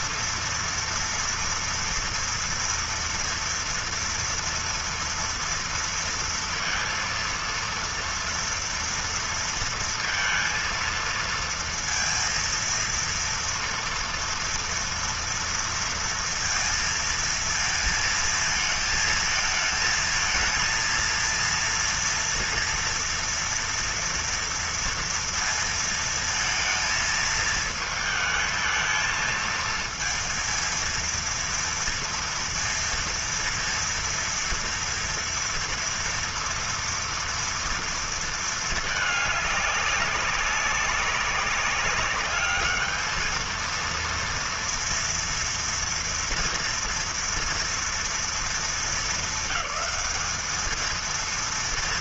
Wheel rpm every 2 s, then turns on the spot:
230, 230, 230, 230, 230, 230, 230, 230, 230, 220, 230, 230, 230, 230, 220, 230, 230, 230, 230, 220, 190, 210, 230, 230, 220, 220.
none